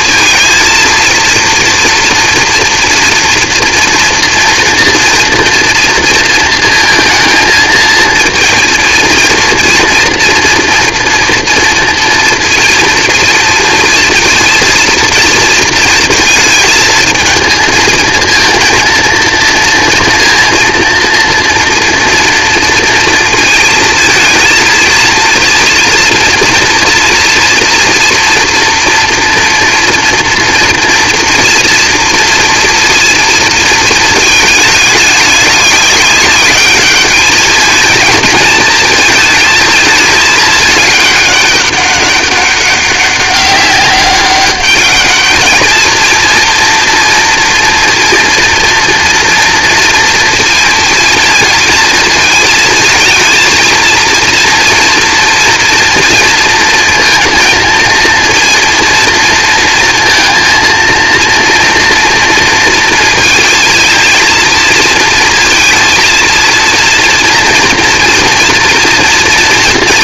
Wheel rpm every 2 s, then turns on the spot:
230, 240, 230, 230, 230, 230, 230, 230, 220, 230, 240, 230, 230, 230, 240, 230, 230, 210, 210, 230, 210, 200, 210, 230, 230, 230, 220, 230, 230, 230, 230, 230, 230, 230, 230.
none